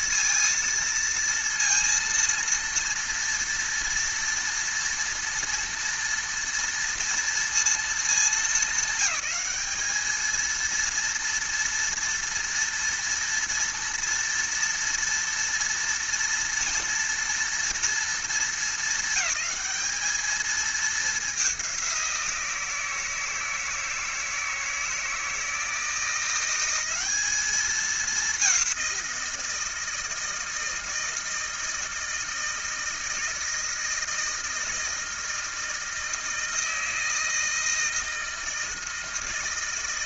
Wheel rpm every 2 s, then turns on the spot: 230, 230, 230, 230, 200, 230, 230, 230, 230, 220, 210, 160, 160, 200, 180, 160, 160, 160, 160, 160.
none